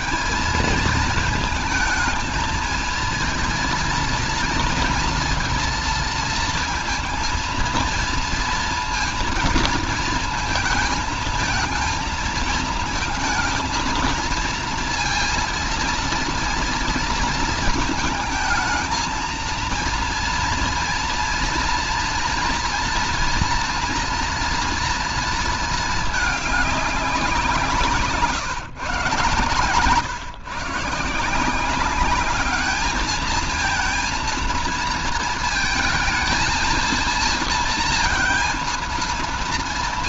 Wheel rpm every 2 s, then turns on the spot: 220, 220, 230, 230, 230, 220, 220, 230, 230, 220, 230, 230, 230, 210, 140, 120, 200, 230, 220, 230.
none